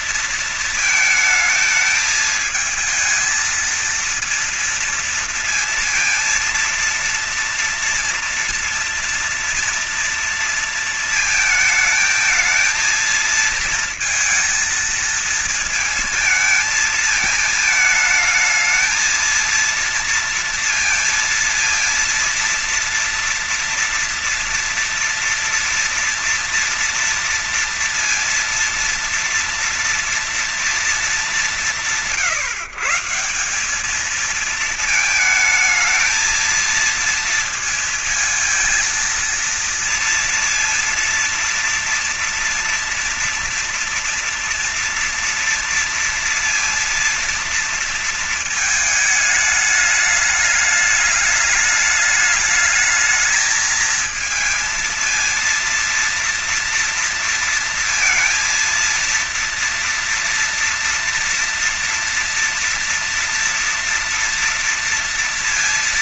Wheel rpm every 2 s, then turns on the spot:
230, 220, 230, 230, 230, 230, 220, 230, 220, 220, 230, 230, 230, 230, 230, 230, 160, 210, 220, 230, 230, 240, 230, 230, 220, 210, 210, 230, 230, 230, 230, 230, 230.
none